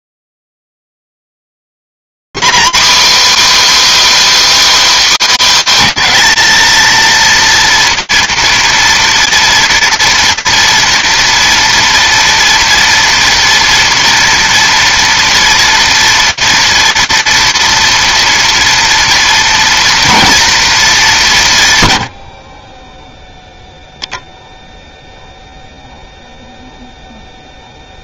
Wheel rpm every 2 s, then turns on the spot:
270, 270, 330, 280, 230, 230, 240, 230, 230, 230, 230, 120, 0, 0.
none